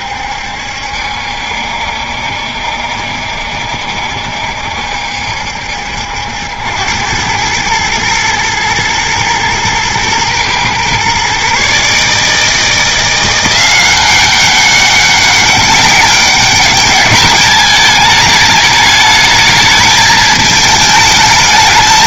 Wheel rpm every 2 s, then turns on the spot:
70, 70, 70, 80, 120, 120, 160, 190, 200, 210, 220.
none